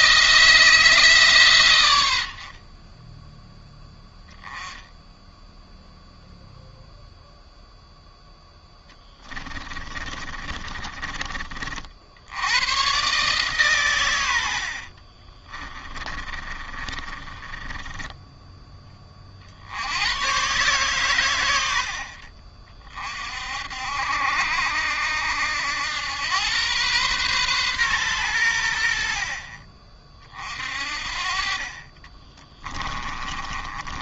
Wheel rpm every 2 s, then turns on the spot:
160, 30, 10, 0, 10, 30, 120, 60, 30, 20, 130, 50, 70, 120, 70, 50, 20.
8-12 14-18 32-34